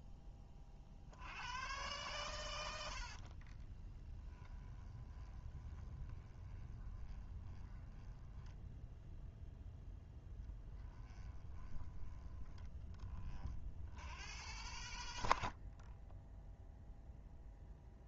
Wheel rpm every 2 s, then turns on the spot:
60, 70, 20, 20, 0, 10, 20, 100, 0.
2-8 10-12